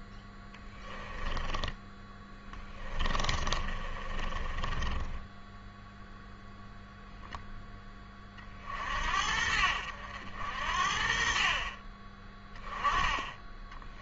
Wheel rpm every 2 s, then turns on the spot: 10, 20, 20, 0, 50, 60, 10.
0-6